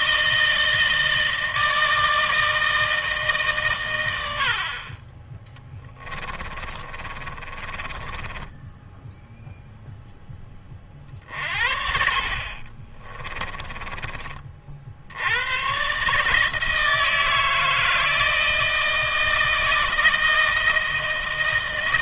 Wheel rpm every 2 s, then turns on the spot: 160, 160, 60, 20, 10, 20, 40, 50, 150, 160, 160.
6-10 12-14